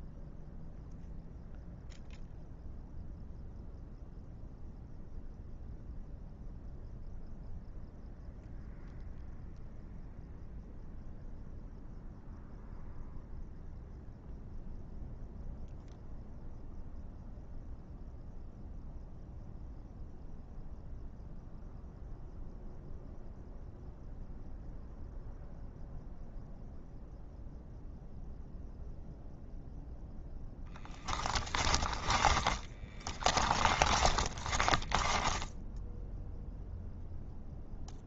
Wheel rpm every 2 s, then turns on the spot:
0, 0, 0, 0, 0, 0, 0, 0, 0, 0, 0, 0, 0, 0, 0, 0, 10, 10, 0.
32-36